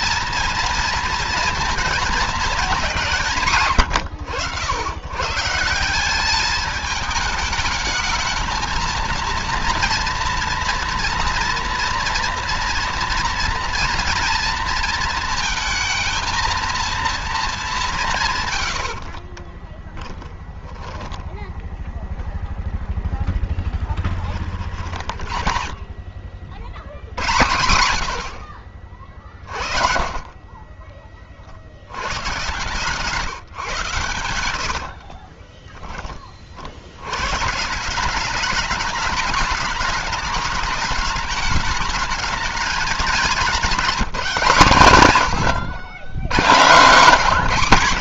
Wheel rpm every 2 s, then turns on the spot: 230, 190, 100, 210, 230, 230, 240, 230, 230, 110, 10, 0, 40, 90, 70, 40, 150, 60, 70, 210, 210, 210, 130, 150.
18-22 30-32 34-36